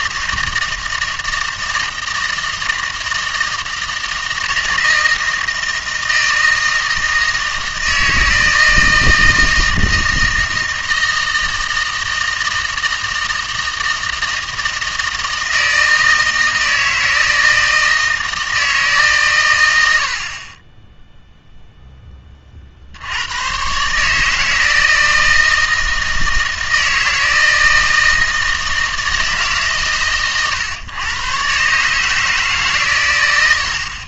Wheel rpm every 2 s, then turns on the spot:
160, 160, 160, 160, 160, 160, 160, 160, 160, 160, 20, 50, 160, 160, 160, 120, 140.
none